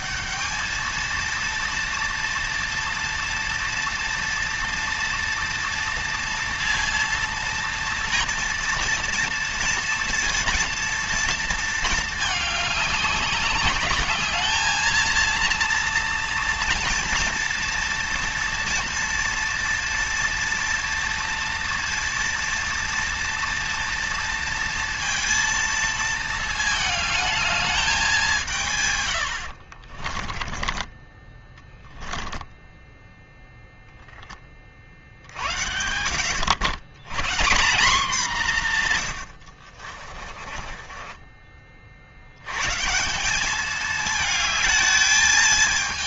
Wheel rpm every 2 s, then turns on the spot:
220, 230, 230, 230, 230, 230, 200, 220, 230, 230, 230, 230, 230, 220, 130, 20, 0, 40, 110, 130, 20, 150, 220.
30-32 40-42